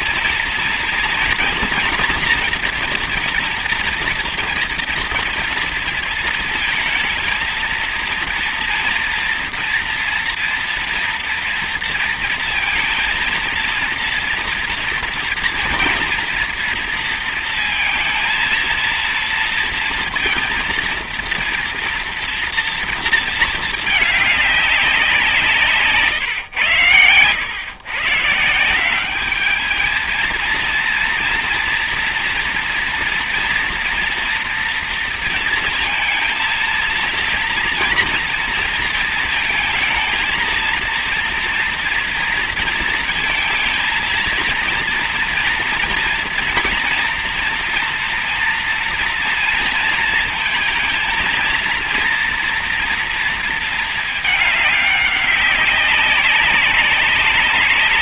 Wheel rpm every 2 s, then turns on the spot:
230, 230, 230, 220, 230, 230, 230, 230, 230, 230, 230, 230, 180, 110, 180, 230, 230, 230, 230, 230, 230, 230, 230, 230, 230, 230, 230, 200, 200.
none